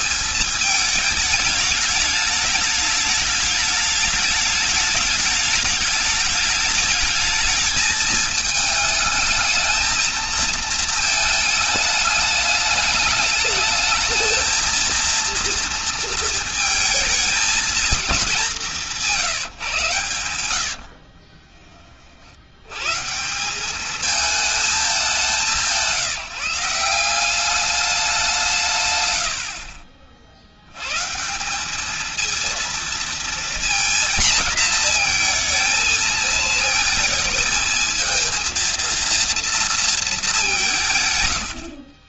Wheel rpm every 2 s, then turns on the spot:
220, 210, 210, 210, 220, 220, 210, 230, 230, 190, 80, 110, 210, 180, 160, 80, 230, 230, 230, 230, 190.
20-22